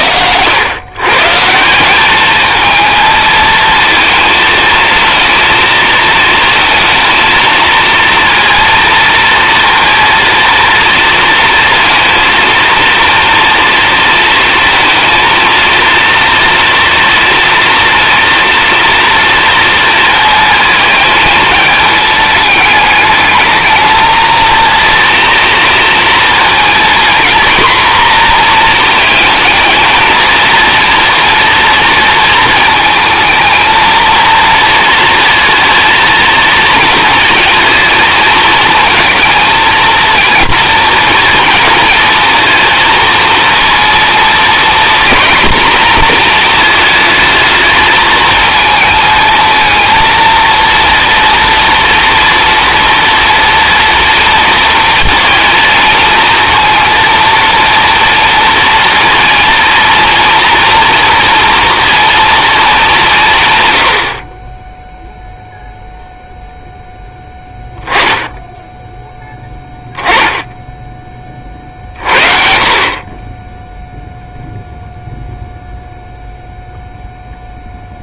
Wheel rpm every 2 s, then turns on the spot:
120, 220, 220, 230, 230, 230, 230, 230, 230, 230, 220, 210, 230, 230, 230, 230, 220, 230, 230, 220, 230, 230, 230, 230, 220, 230, 230, 230, 230, 230, 240, 200, 10, 0, 10, 10, 50, 0, 0.
none